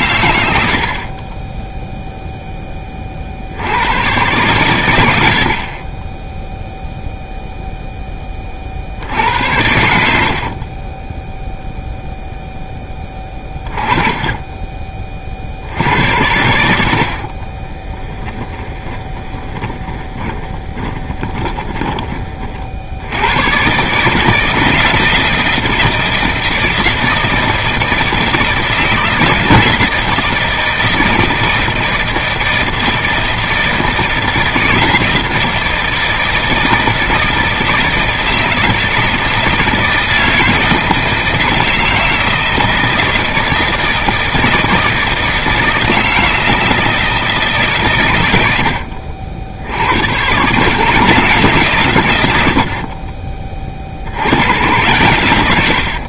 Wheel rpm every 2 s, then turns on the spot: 70, 30, 100, 0, 50, 30, 10, 30, 70, 20, 20, 70, 170, 160, 160, 160, 160, 160, 160, 160, 160, 160, 160, 160, 70, 150, 40, 110.
10-12 18-22